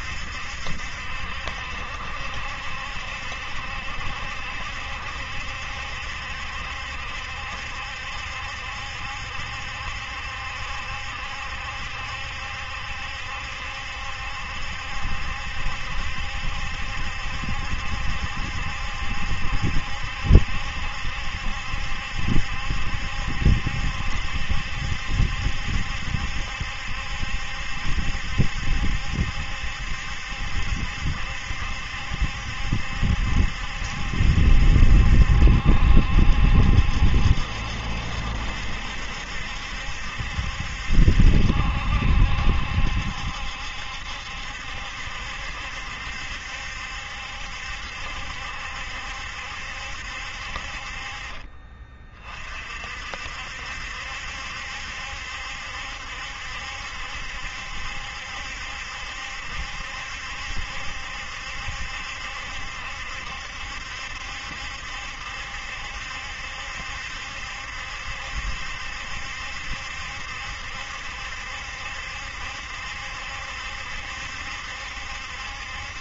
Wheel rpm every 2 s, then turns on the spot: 70, 70, 70, 70, 70, 70, 70, 70, 70, 70, 70, 70, 70, 70, 70, 70, 70, 70, 70, 70, 70, 70, 70, 70, 70, 40, 60, 70, 70, 70, 70, 70, 70, 70, 70, 70, 70, 70.
none